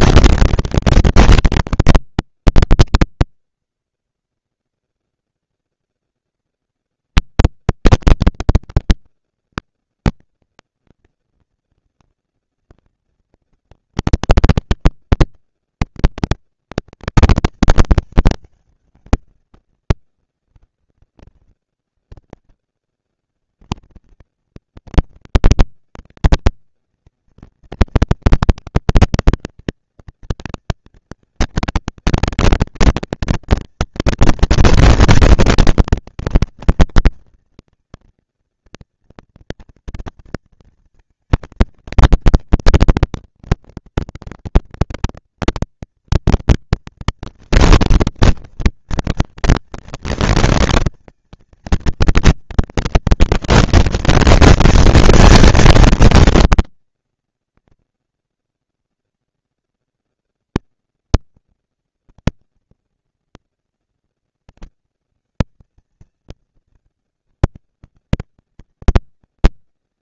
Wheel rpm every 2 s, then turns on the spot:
230, 230, 230, 230, 230, 230, 230, 230, 230, 210, 190, 100, 190, 220, 230, 230, 230, 230, 230, 230, 230, 230, 230, 230, 230, 230, 230, 220, 230, 230, 230, 230, 230, 220, 200.
none